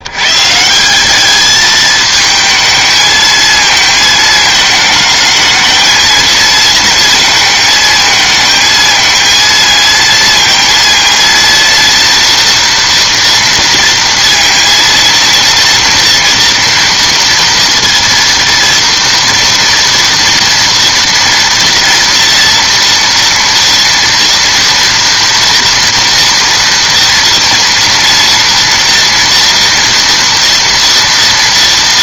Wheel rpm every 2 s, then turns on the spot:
170, 220, 220, 220, 220, 230, 230, 230, 230, 230, 230, 240, 230, 230, 230, 230.
none